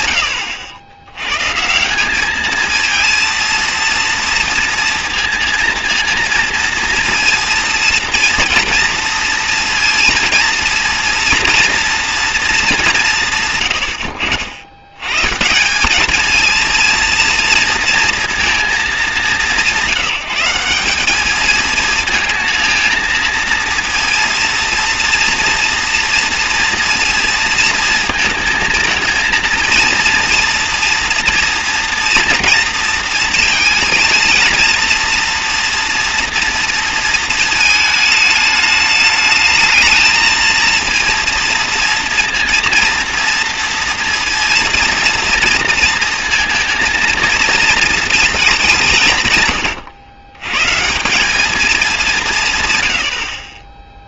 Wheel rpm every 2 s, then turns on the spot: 90, 220, 230, 230, 230, 230, 220, 70, 230, 230, 180, 230, 230, 230, 220, 230, 230, 230, 230, 210, 230, 230, 230, 230, 200, 110, 150.
none